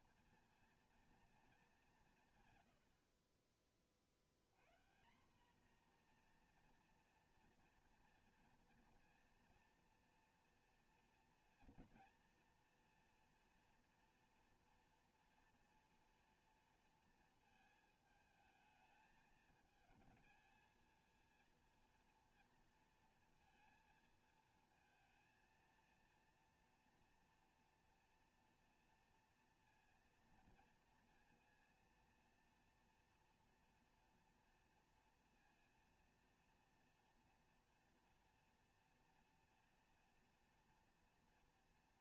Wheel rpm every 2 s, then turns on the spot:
230, 120, 110, 240, 230, 230, 230, 230, 230, 220, 230, 230, 220, 230, 230, 230, 230, 230, 230, 230, 230.
none